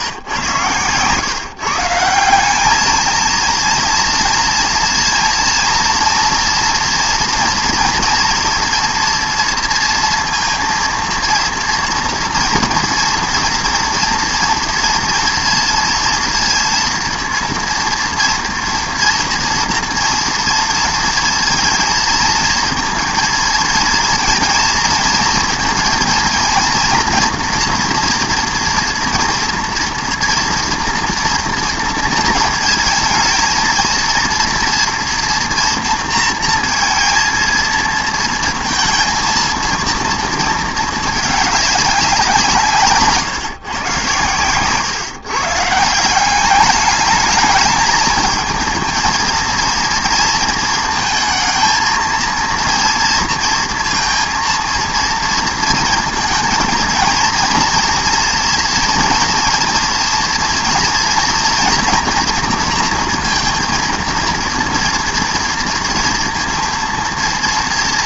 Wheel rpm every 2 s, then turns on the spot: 130, 190, 230, 240, 230, 230, 230, 240, 230, 230, 230, 230, 220, 230, 230, 240, 230, 230, 230, 220, 220, 160, 120, 200, 220, 230, 230, 230, 230, 230, 240, 230, 230, 230.
none